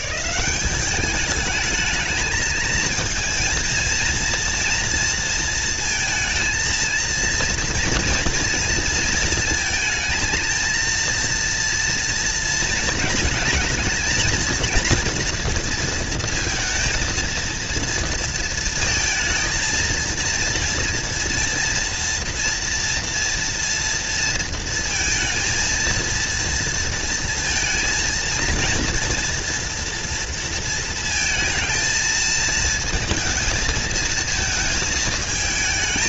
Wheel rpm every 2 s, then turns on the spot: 190, 220, 230, 230, 230, 230, 230, 230, 220, 230, 230, 240, 230, 230, 230, 230, 220, 220.
none